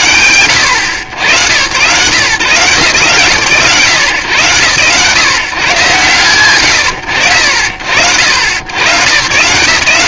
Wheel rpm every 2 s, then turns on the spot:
110, 140, 140, 60, 120.
none